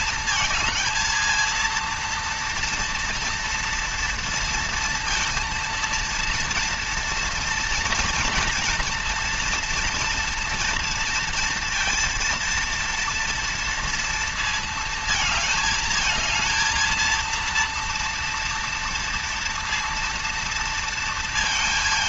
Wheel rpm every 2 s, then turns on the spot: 220, 230, 230, 230, 230, 230, 230, 220, 220, 230, 230.
none